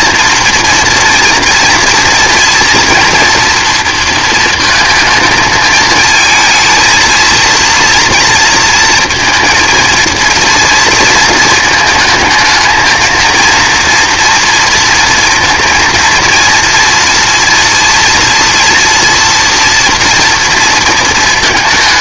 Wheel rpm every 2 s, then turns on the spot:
230, 230, 220, 220, 230, 230, 220, 230, 230, 230, 230.
none